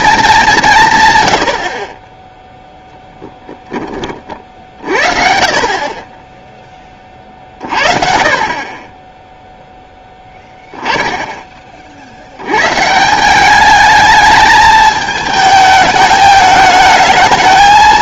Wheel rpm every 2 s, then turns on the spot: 190, 0, 50, 20, 30, 10, 120, 220, 220.
none